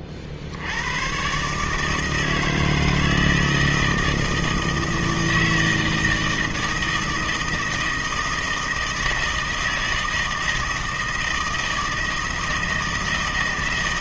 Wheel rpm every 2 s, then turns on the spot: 80, 160, 160, 160, 160, 160, 160.
none